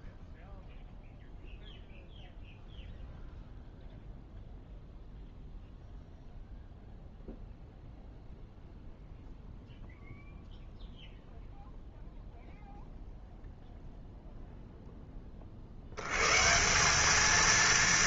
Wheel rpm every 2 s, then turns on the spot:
0, 0, 0, 0, 0, 0, 0, 0, 170.
none